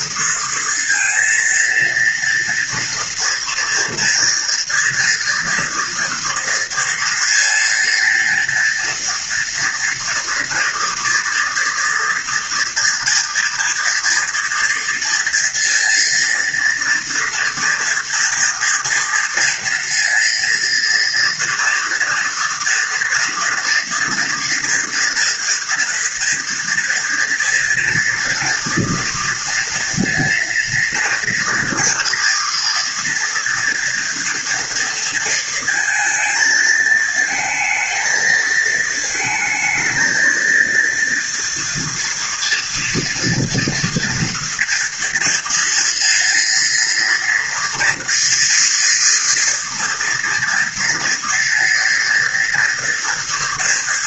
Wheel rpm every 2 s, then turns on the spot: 230, 230, 230, 230, 230, 230, 230, 230, 230, 230, 230, 240, 240, 230, 230, 230, 230, 230, 220, 220, 230, 230, 230, 230, 230, 230, 230.
none